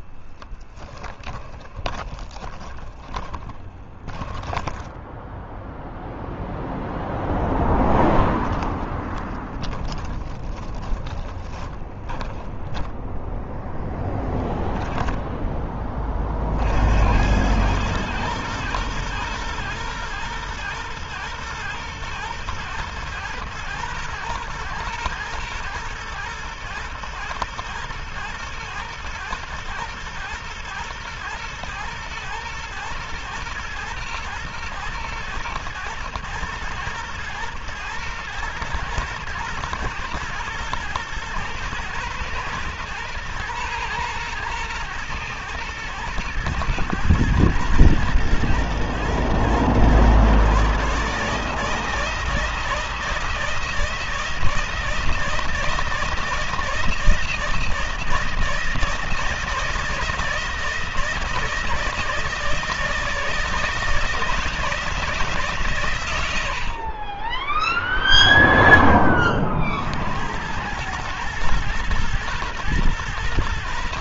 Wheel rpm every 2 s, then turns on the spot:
10, 20, 10, 0, 20, 20, 10, 0, 80, 110, 110, 110, 110, 120, 120, 110, 120, 120, 110, 110, 110, 110, 110, 110, 120, 150, 160, 160, 160, 160, 160, 160, 160, 30, 30, 110, 120.
0-6 8-12